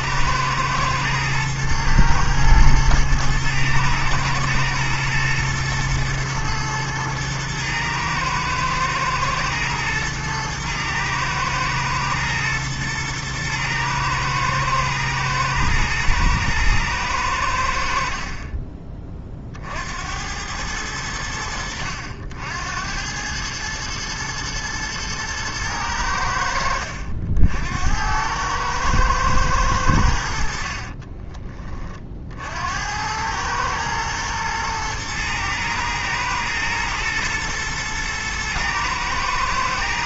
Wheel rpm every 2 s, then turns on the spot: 110, 110, 110, 110, 120, 110, 110, 120, 110, 30, 100, 90, 110, 70, 110, 30, 90, 110, 110, 110.
30-32